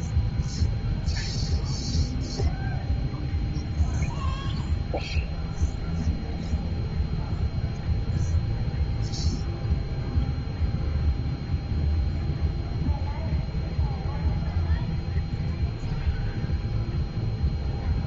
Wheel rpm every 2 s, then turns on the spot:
0, 0, 0, 0, 0, 0, 0, 0, 0.
none